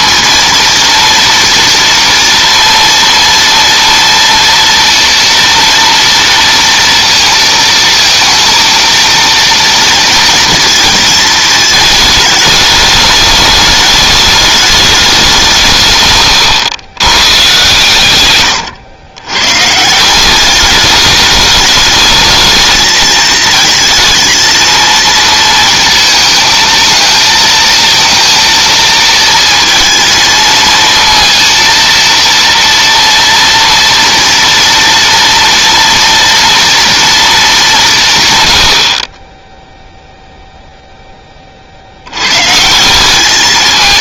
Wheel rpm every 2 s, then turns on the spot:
230, 230, 230, 230, 230, 230, 210, 210, 120, 120, 200, 220, 230, 220, 230, 220, 230, 230, 230, 100, 0, 160.
16-20